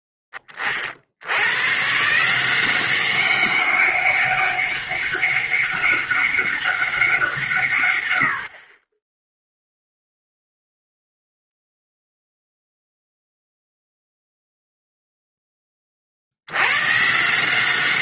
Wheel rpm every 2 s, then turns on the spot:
30, 180, 200, 190, 30, 0, 0, 0, 110.
none